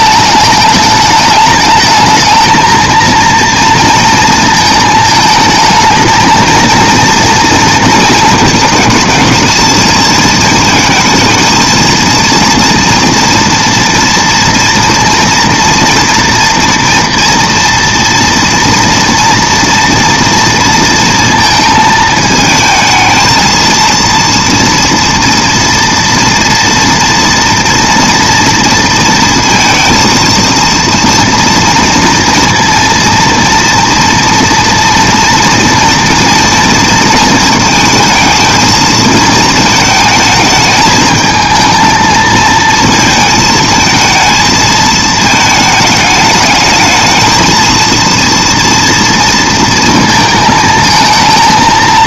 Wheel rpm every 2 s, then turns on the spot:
210, 220, 220, 220, 220, 230, 230, 230, 230, 230, 230, 220, 230, 230, 230, 230, 230, 230, 230, 220, 220, 220, 230, 210, 230, 230.
none